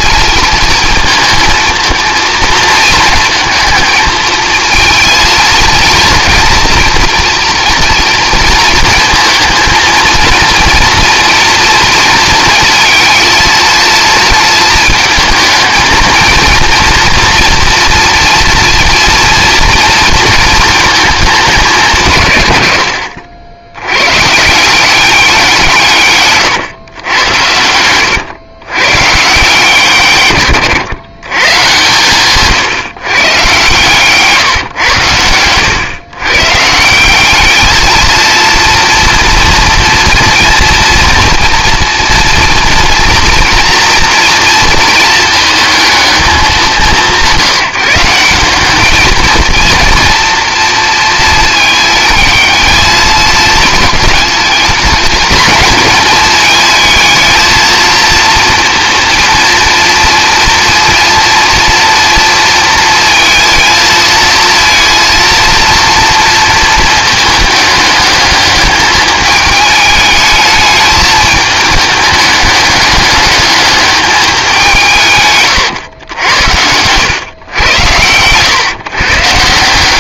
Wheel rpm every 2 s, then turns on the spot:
220, 230, 220, 230, 220, 230, 230, 220, 230, 230, 220, 90, 180, 110, 120, 110, 140, 110, 160, 230, 230, 240, 230, 190, 200, 230, 220, 220, 220, 230, 230, 230, 230, 220, 210, 220, 210, 170, 100, 130.
none